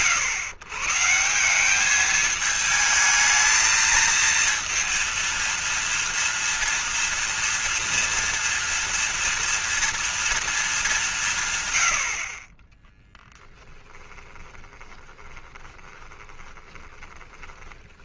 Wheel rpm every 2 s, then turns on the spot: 140, 220, 230, 230, 230, 210, 20, 20, 20.
14-18